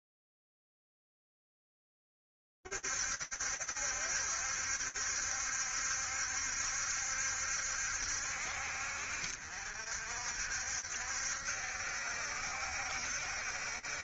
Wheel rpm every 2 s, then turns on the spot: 50, 70, 70, 70, 70, 60, 70.
none